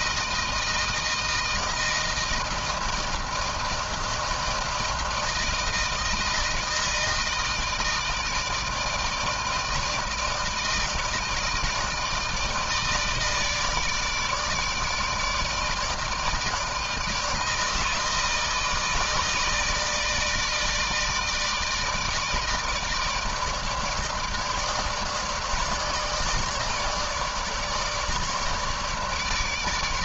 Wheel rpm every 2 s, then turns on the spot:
160, 160, 160, 160, 160, 160, 160, 150, 160, 160, 160, 160, 150, 150, 150.
none